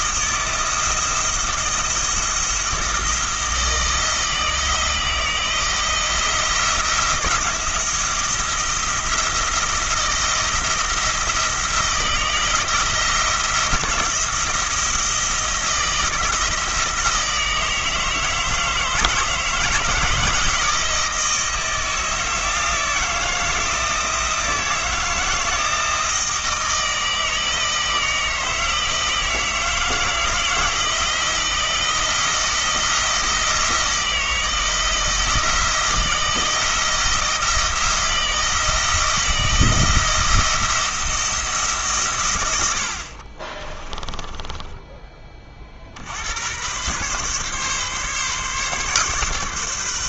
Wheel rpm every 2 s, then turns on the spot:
170, 170, 160, 170, 160, 170, 170, 170, 160, 160, 160, 160, 160, 160, 160, 160, 160, 160, 160, 170, 170, 60, 20, 120, 140.
42-44